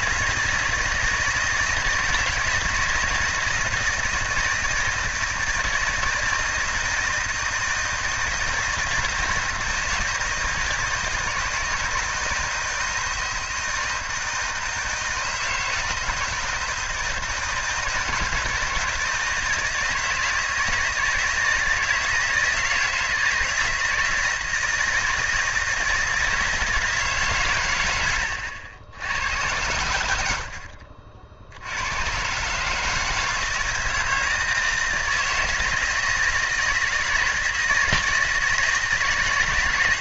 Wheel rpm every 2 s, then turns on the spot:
160, 160, 160, 160, 160, 160, 160, 160, 160, 160, 160, 160, 160, 160, 80, 70, 150, 160, 160, 160.
none